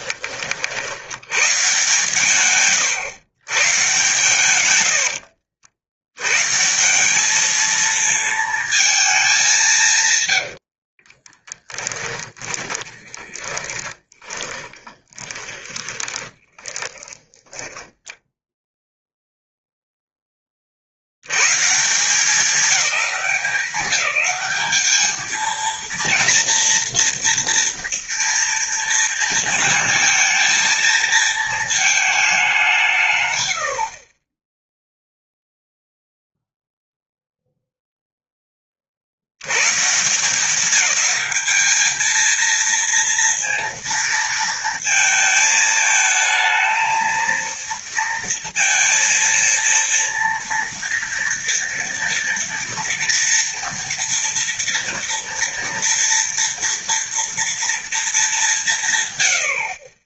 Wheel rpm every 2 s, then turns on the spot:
60, 120, 90, 170, 220, 60, 20, 20, 20, 0, 40, 210, 210, 230, 230, 230, 180, 0, 0, 40, 190, 230, 220, 230, 230, 230, 230, 230, 230, 190.
10-18